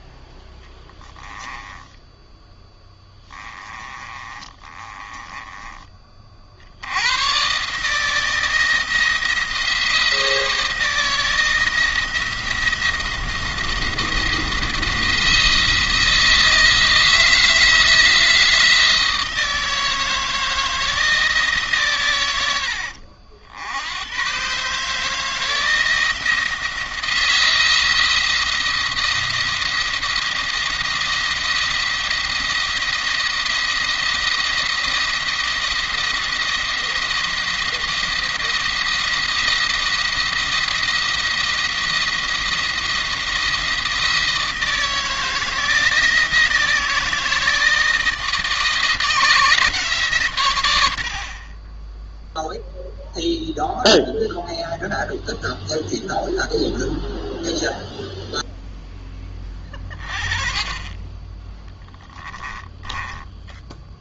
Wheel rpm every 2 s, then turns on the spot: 10, 10, 20, 80, 160, 170, 170, 170, 160, 160, 160, 80, 150, 160, 170, 170, 170, 170, 170, 170, 170, 170, 170, 160, 170, 100, 0, 0, 0, 10, 20, 10.
0-6 62-64